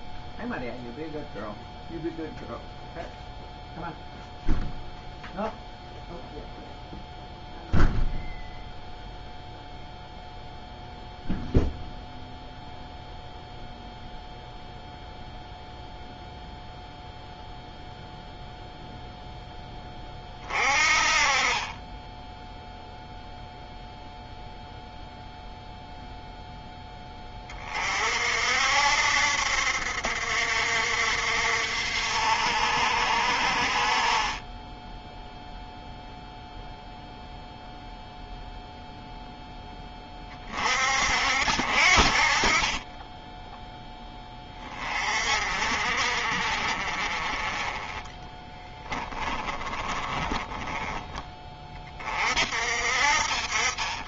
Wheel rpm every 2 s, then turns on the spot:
0, 0, 0, 0, 0, 0, 0, 0, 0, 0, 40, 0, 0, 10, 70, 60, 60, 10, 0, 0, 60, 20, 30, 40, 20, 20, 60.
48-50